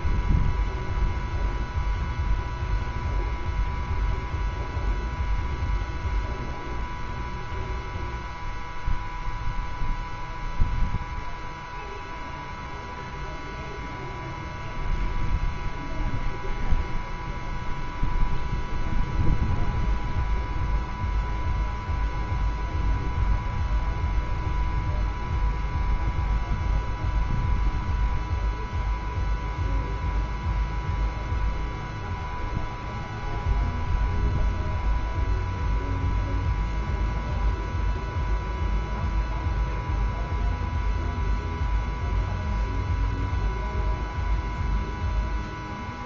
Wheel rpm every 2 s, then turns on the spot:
0, 0, 0, 0, 0, 0, 0, 0, 0, 0, 0, 0, 0, 0, 0, 0, 0, 0, 0, 0, 0, 0, 0.
none